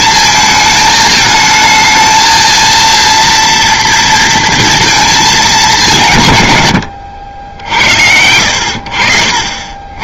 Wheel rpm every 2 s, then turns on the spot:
220, 230, 230, 120, 80.
none